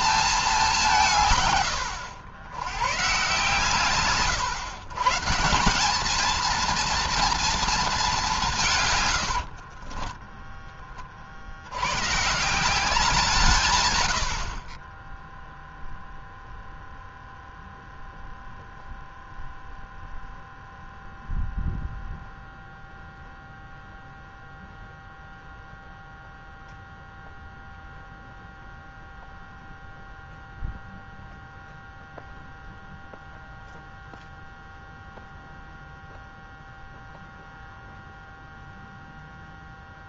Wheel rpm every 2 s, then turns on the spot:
200, 100, 130, 230, 150, 10, 160, 40, 0, 0, 0, 0, 0, 0, 0, 0, 0, 0, 0, 0.
8-10